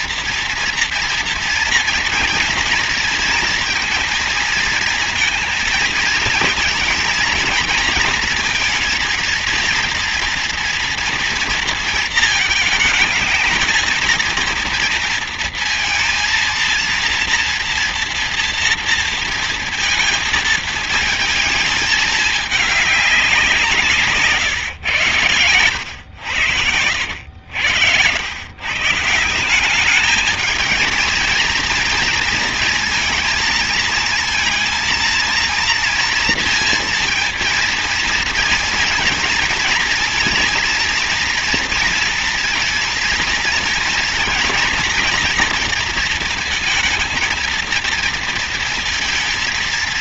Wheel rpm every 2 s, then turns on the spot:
230, 230, 230, 230, 230, 230, 220, 230, 230, 230, 230, 190, 110, 80, 150, 230, 230, 230, 230, 230, 230, 230, 230, 230, 230.
none